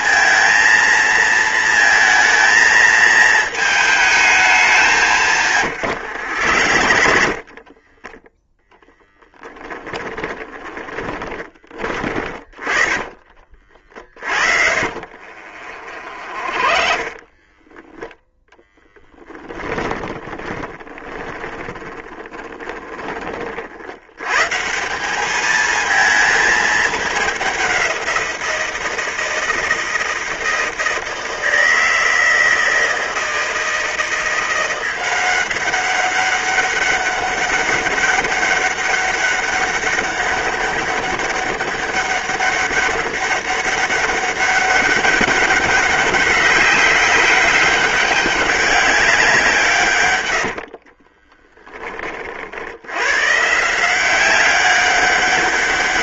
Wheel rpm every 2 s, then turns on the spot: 220, 220, 160, 50, 0, 20, 30, 50, 20, 10, 10, 20, 180, 210, 170, 160, 160, 180, 200, 200, 200, 200, 200, 200, 190, 30, 100, 190.
4-8 10-22 50-52